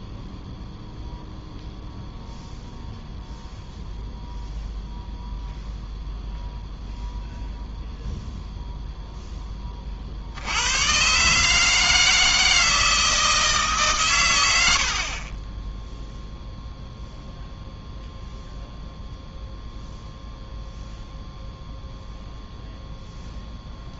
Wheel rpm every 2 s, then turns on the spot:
0, 0, 0, 0, 0, 90, 160, 80, 0, 0, 0, 0.
none